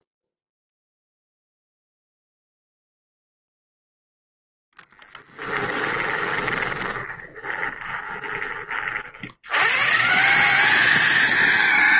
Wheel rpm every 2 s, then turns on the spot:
0, 0, 0, 20, 40, 210.
6-8